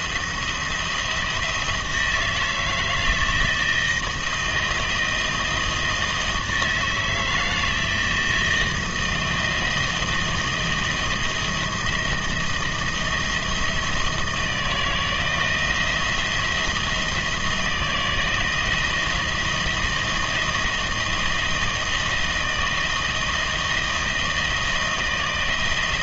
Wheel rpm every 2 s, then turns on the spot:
170, 160, 170, 160, 170, 170, 160, 170, 160, 170, 160, 160, 160.
none